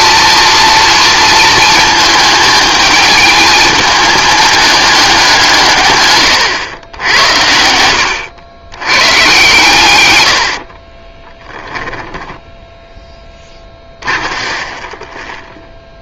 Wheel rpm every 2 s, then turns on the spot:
230, 220, 200, 100, 110, 40, 10, 30.
10-12 14-16